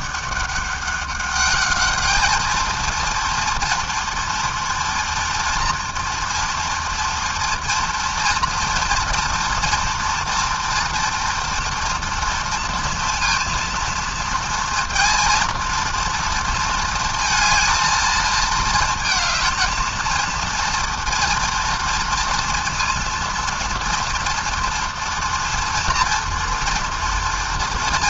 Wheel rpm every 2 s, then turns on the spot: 200, 220, 230, 230, 230, 230, 230, 230, 230, 220, 230, 230, 230, 230.
none